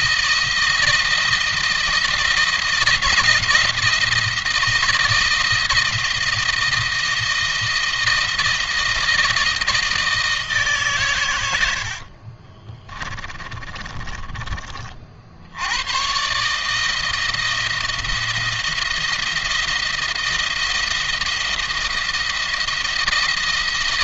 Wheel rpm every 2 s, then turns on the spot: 160, 160, 170, 170, 160, 150, 30, 30, 150, 170, 170, 170.
12-14